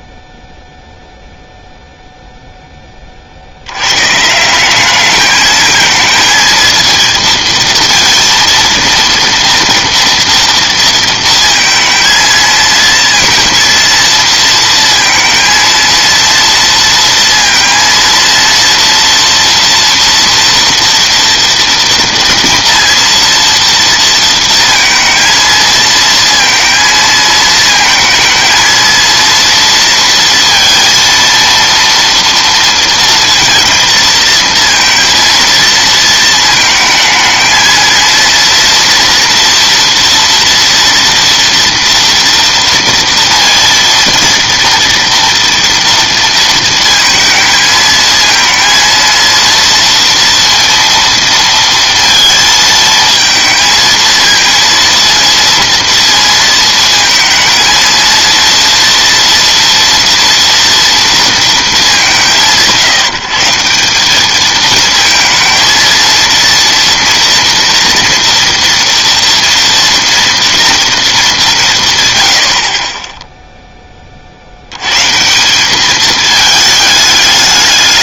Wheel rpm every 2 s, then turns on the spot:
0, 50, 210, 230, 230, 230, 230, 230, 230, 230, 230, 230, 230, 220, 230, 230, 230, 230, 220, 240, 230, 230, 230, 220, 230, 230, 220, 230, 230, 230, 230, 170, 220, 230, 230, 210, 10, 140, 210.
none